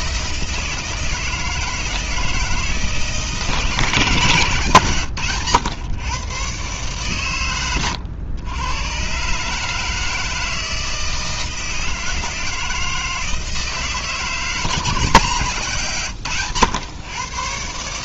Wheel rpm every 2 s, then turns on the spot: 160, 160, 140, 130, 110, 160, 160, 160, 110.
none